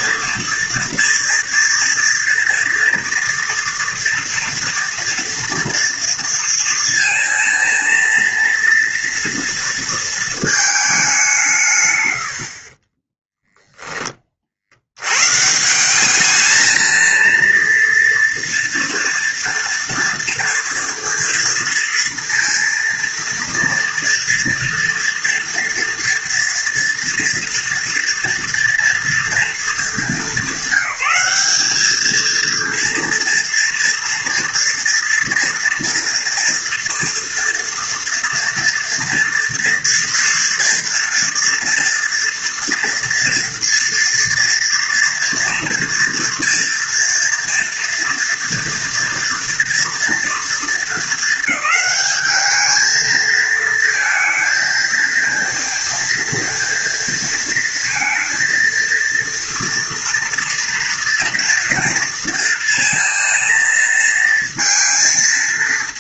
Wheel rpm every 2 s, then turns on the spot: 230, 230, 230, 230, 230, 190, 20, 110, 230, 230, 230, 230, 230, 230, 230, 200, 230, 230, 230, 230, 230, 230, 230, 230, 230, 220, 220, 230, 230, 230, 230, 230, 230.
12-14